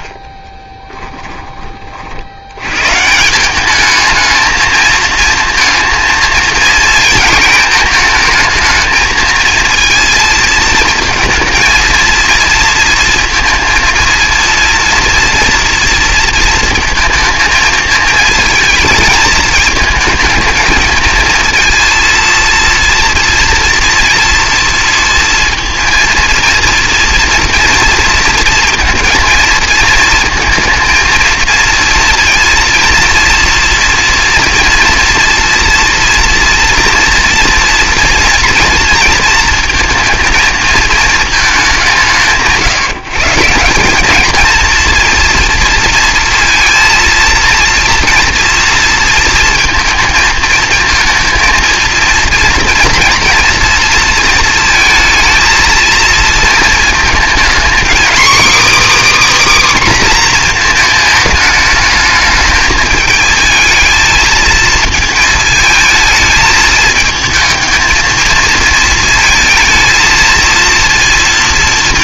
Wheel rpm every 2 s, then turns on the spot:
20, 100, 220, 230, 230, 230, 230, 230, 230, 220, 220, 230, 230, 230, 230, 230, 230, 230, 230, 230, 220, 160, 230, 230, 230, 220, 230, 230, 230, 290, 240, 220, 220, 220, 220, 230.
0-2